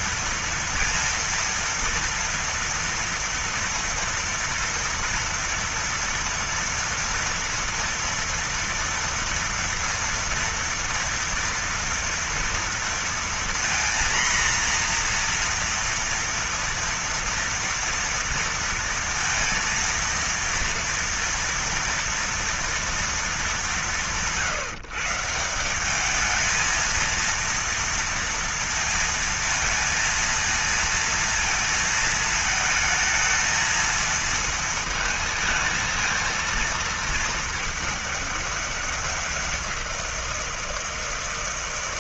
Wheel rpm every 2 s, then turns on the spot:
230, 230, 240, 230, 230, 230, 230, 240, 230, 230, 230, 230, 140, 220, 230, 230, 220, 220, 230, 200, 170.
none